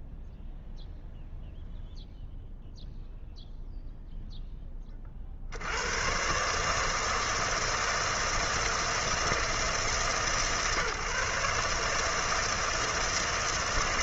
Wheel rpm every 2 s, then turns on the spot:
0, 0, 10, 150, 160, 140, 160.
none